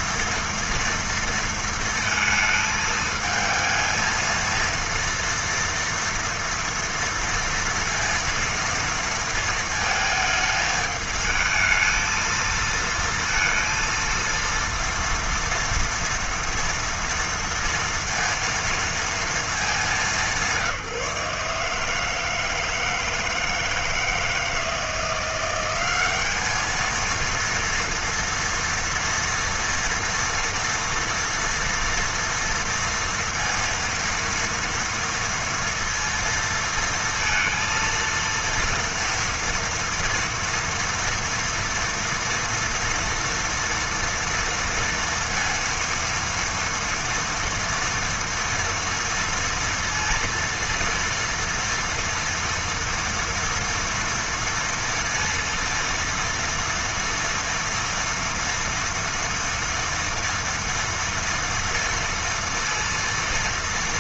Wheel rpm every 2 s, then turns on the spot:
230, 220, 230, 230, 230, 220, 230, 230, 240, 230, 170, 160, 160, 210, 230, 230, 230, 230, 230, 230, 230, 230, 230, 230, 230, 230, 230, 230, 230, 230, 240, 230.
none